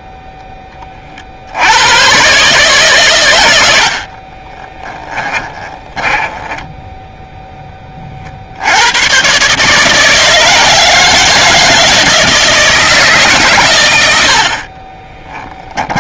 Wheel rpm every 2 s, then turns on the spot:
0, 130, 40, 10, 80, 160, 160, 60.
4-8